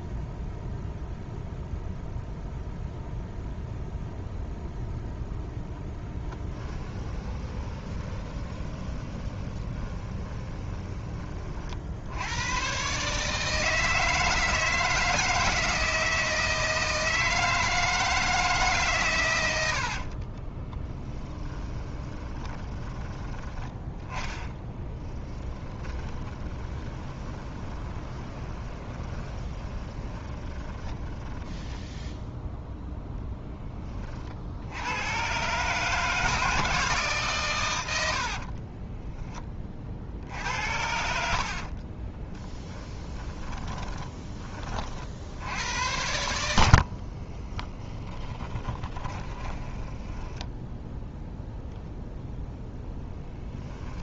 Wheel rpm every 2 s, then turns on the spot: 0, 0, 0, 20, 20, 20, 120, 160, 160, 140, 20, 20, 10, 20, 20, 10, 0, 70, 160, 30, 70, 20, 50, 60, 20, 0, 0.
6-12 20-32 38-40 42-44 48-50